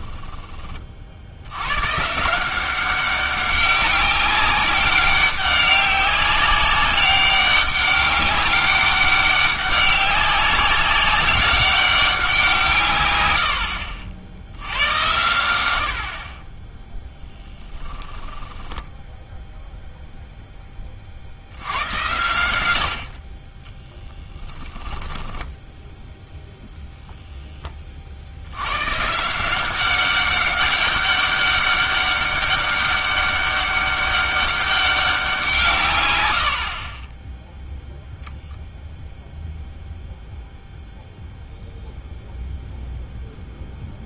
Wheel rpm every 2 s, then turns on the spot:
30, 180, 190, 200, 200, 200, 150, 80, 10, 10, 20, 80, 10, 0, 90, 200, 200, 200, 50, 0, 0, 0.
18-20 24-26